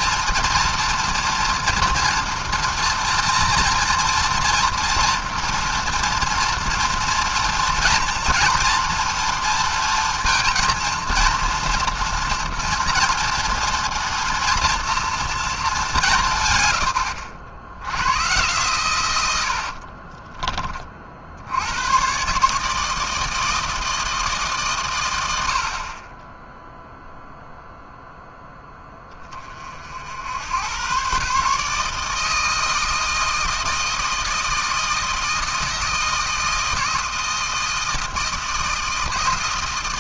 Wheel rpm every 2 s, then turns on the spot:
230, 230, 230, 230, 230, 230, 230, 230, 120, 120, 30, 150, 140, 10, 0, 90, 160, 160, 160, 160.
20-22